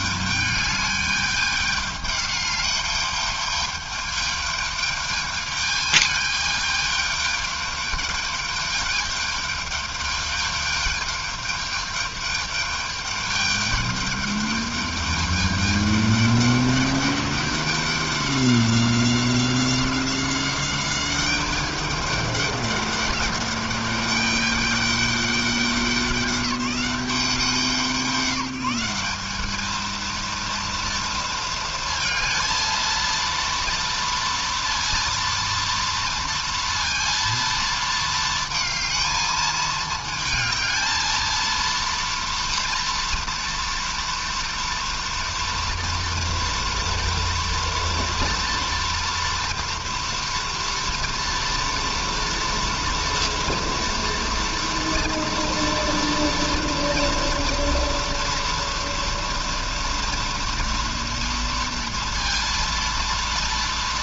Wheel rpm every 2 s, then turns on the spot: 210, 210, 210, 210, 210, 210, 210, 210, 210, 190, 190, 200, 200, 190, 180, 230, 230, 230, 230, 220, 220, 230, 230, 230, 230, 230, 230, 230, 230, 230, 230, 230.
none